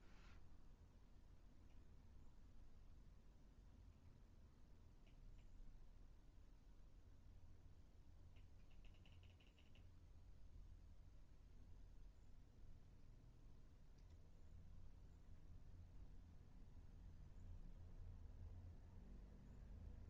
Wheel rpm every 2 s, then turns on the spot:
0, 0, 0, 0, 0, 0, 0, 0, 0, 0.
none